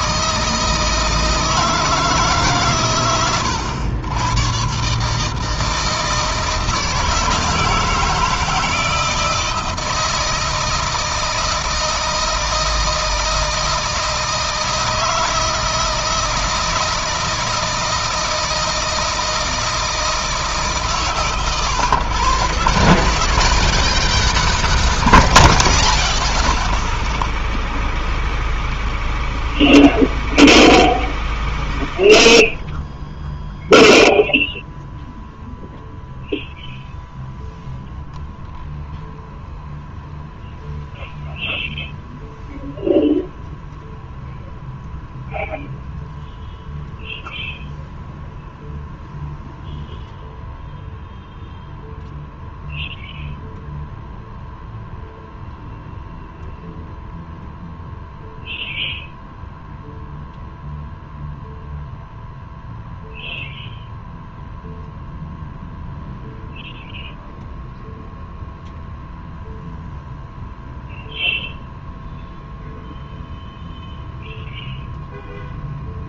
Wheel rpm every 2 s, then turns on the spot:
160, 140, 120, 160, 160, 160, 160, 160, 160, 160, 150, 110, 10, 0, 0, 0, 0, 0, 0, 0, 0, 0, 0, 0, 0, 0, 0, 0, 0, 0, 0, 0, 0, 0, 0, 0, 0, 0.
24-26